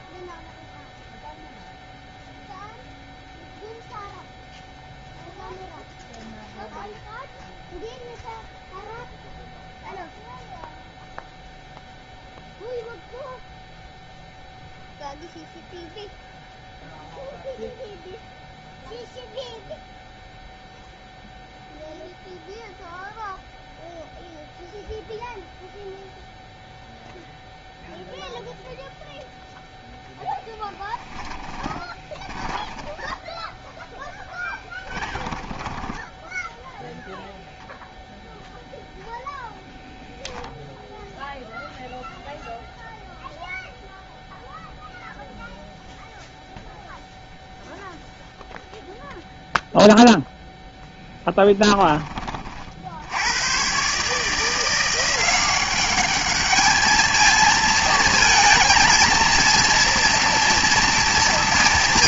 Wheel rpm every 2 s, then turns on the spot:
0, 0, 0, 0, 0, 0, 0, 0, 0, 0, 0, 0, 0, 0, 0, 10, 10, 10, 0, 0, 0, 0, 0, 0, 0, 0, 60, 170, 210, 230, 240.
30-36